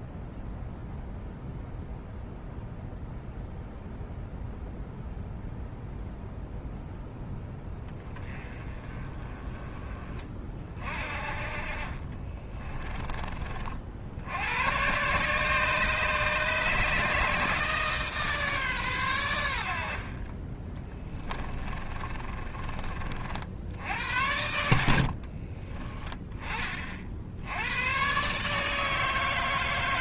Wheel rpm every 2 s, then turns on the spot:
0, 0, 0, 0, 30, 40, 20, 110, 150, 130, 20, 40, 80, 40, 150.
20-22 24-26